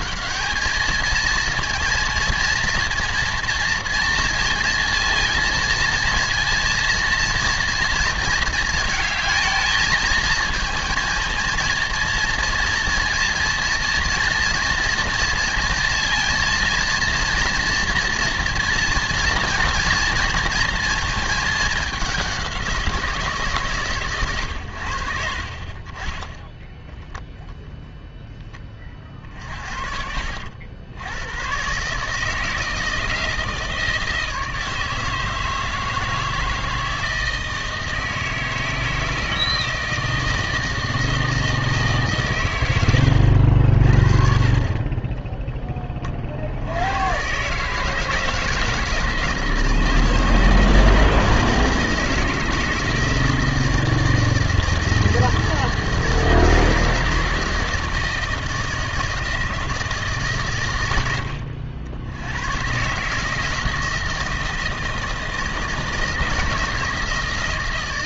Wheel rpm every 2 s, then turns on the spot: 220, 230, 230, 230, 230, 230, 230, 230, 230, 230, 230, 180, 90, 0, 20, 80, 160, 160, 160, 160, 160, 110, 40, 70, 160, 160, 160, 160, 160, 160, 120, 130, 160, 160.
44-46